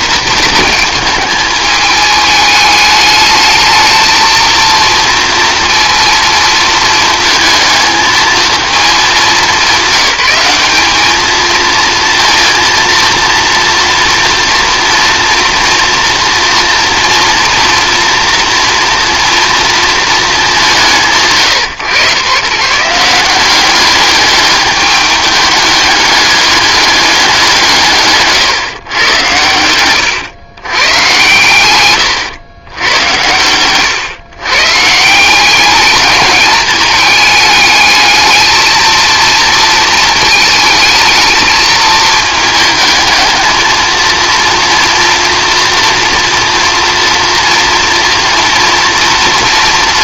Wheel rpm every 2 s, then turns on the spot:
220, 210, 230, 220, 220, 200, 230, 240, 230, 230, 190, 140, 210, 200, 130, 120, 100, 140, 220, 220, 220, 220, 230, 230, 230.
none